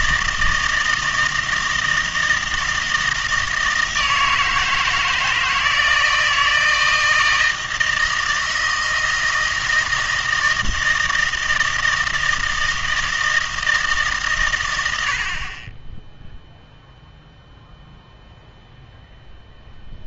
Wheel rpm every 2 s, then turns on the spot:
160, 160, 160, 160, 160, 160, 160, 90, 0, 0.
none